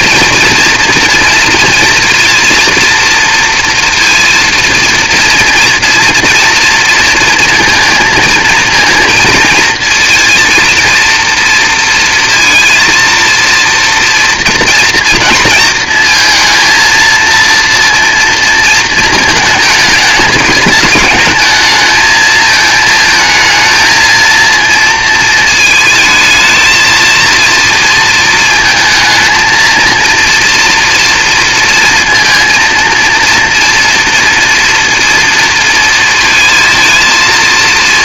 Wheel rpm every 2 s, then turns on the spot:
230, 230, 230, 230, 230, 230, 230, 230, 230, 230, 220, 220, 230, 220, 230, 230, 230, 230, 220.
none